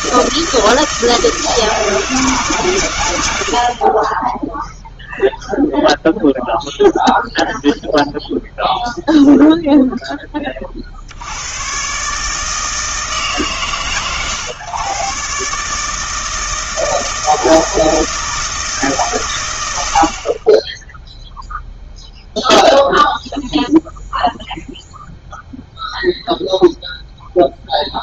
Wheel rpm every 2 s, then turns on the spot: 160, 140, 0, 0, 0, 40, 160, 130, 160, 160, 20, 0, 0, 0.
none